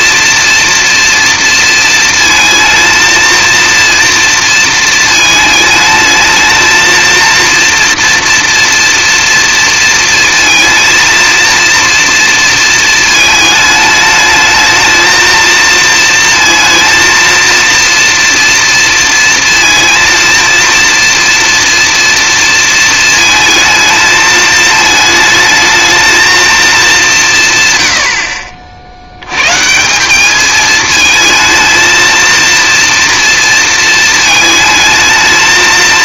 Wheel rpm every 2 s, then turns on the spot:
230, 230, 230, 230, 240, 230, 230, 220, 230, 230, 230, 230, 220, 210, 60, 210, 230, 220.
none